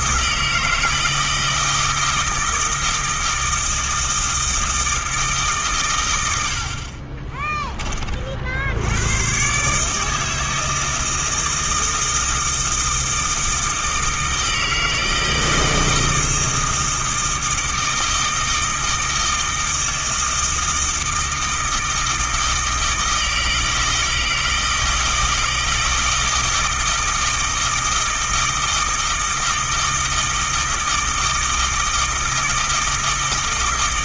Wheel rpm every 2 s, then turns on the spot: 160, 160, 160, 50, 90, 160, 160, 160, 160, 160, 160, 160, 160, 160, 160, 160, 160.
none